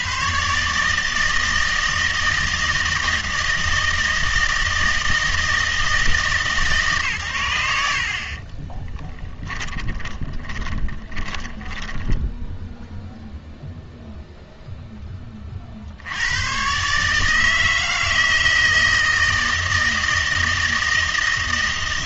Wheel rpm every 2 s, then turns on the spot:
140, 160, 160, 150, 30, 30, 10, 0, 120, 160, 160.
8-12